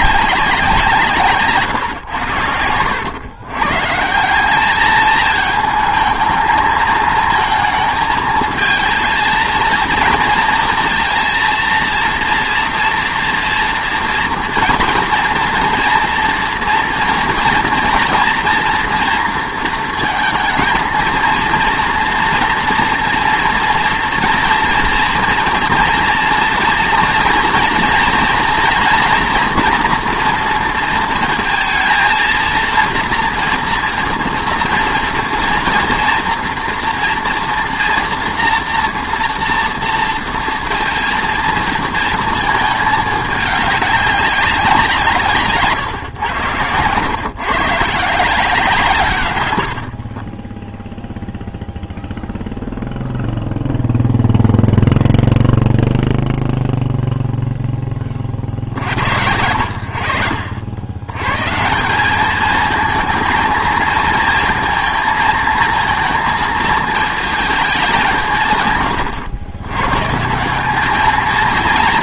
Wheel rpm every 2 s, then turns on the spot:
180, 90, 210, 220, 220, 230, 240, 230, 230, 230, 230, 230, 230, 230, 230, 230, 230, 230, 240, 230, 230, 220, 180, 110, 150, 0, 0, 0, 0, 50, 70, 220, 220, 220, 130, 200.
none